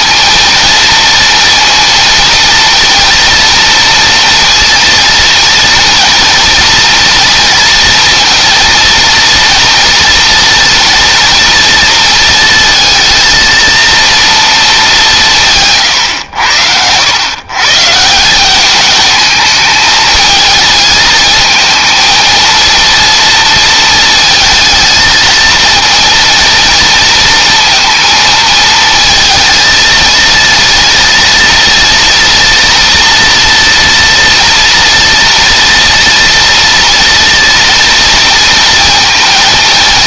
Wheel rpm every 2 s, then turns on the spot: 230, 230, 230, 230, 230, 230, 230, 190, 100, 210, 220, 230, 220, 230, 230, 230, 230, 230, 230, 230.
none